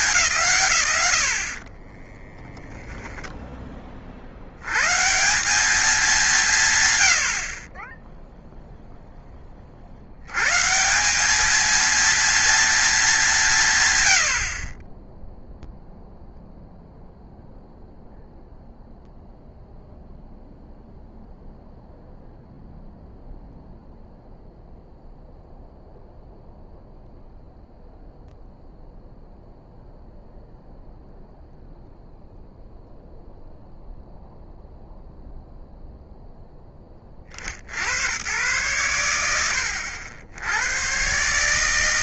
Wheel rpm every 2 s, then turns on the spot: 130, 10, 80, 160, 0, 140, 230, 30, 0, 0, 0, 0, 0, 0, 0, 0, 0, 0, 20, 110, 110.
none